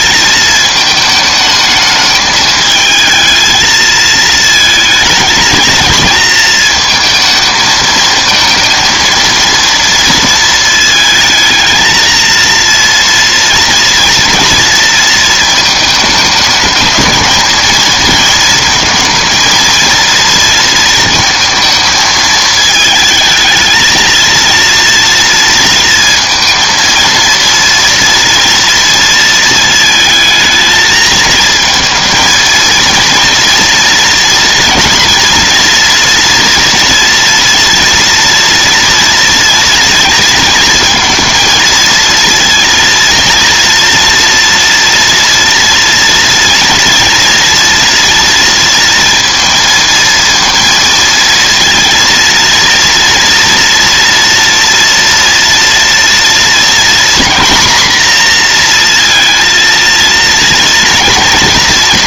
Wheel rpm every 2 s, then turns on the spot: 220, 220, 230, 230, 230, 220, 230, 230, 220, 230, 230, 220, 230, 230, 230, 220, 230, 230, 230, 230, 220, 230, 230, 240, 230, 230, 230, 240, 240, 240, 230.
none